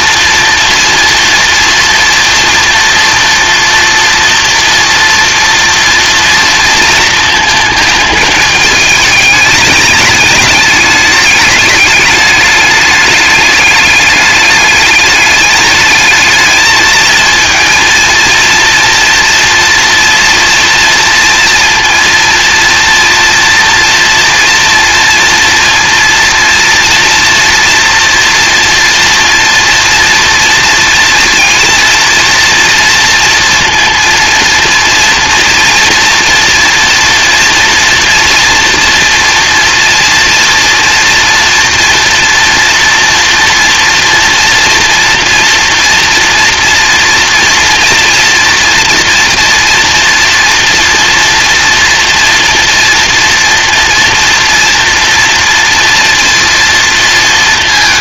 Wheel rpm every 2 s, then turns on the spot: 230, 230, 230, 230, 220, 210, 210, 210, 220, 230, 240, 230, 230, 230, 230, 230, 230, 230, 240, 230, 240, 240, 230, 230, 240, 230, 230, 230, 230.
none